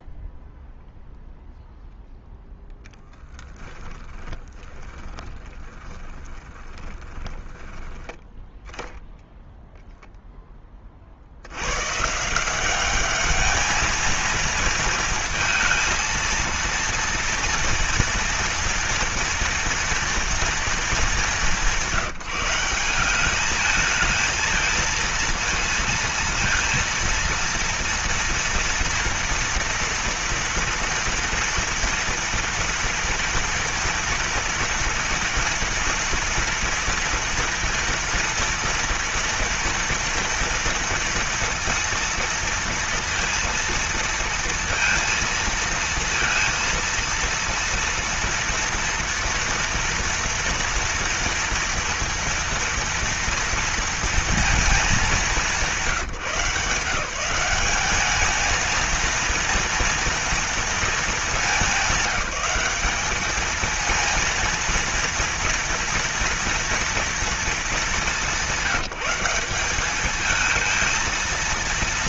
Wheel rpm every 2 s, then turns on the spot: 0, 10, 20, 20, 0, 30, 190, 230, 230, 230, 220, 190, 230, 230, 230, 230, 230, 240, 230, 230, 230, 230, 230, 230, 230, 240, 230, 210, 160, 230, 220, 200, 230, 230, 190, 230.
2-8